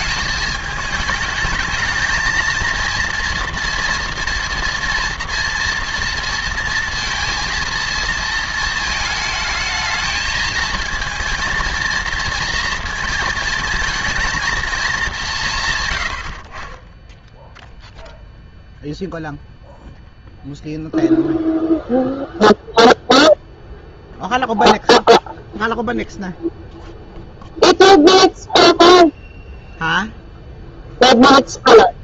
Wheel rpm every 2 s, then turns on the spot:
220, 230, 230, 230, 220, 220, 230, 220, 30, 0, 0, 0, 0, 0, 0, 0.
none